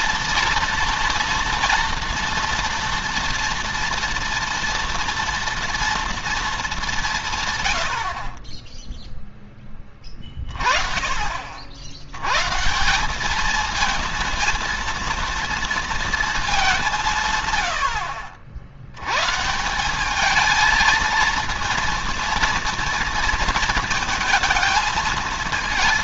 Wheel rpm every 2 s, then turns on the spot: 230, 230, 230, 220, 20, 30, 130, 230, 210, 70, 220, 230, 220.
none